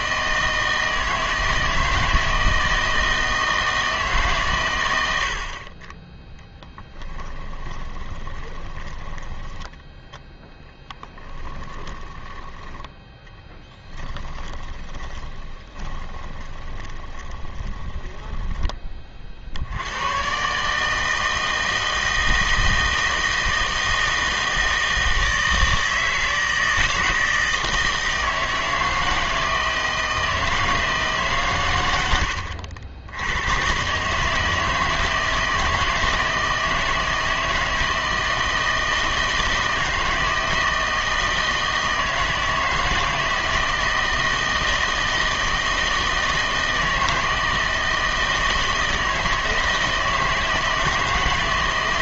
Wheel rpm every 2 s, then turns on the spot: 160, 160, 120, 10, 20, 10, 10, 20, 20, 20, 150, 160, 160, 160, 160, 160, 70, 160, 160, 160, 160, 160, 160, 160, 160, 160.
6-10 14-18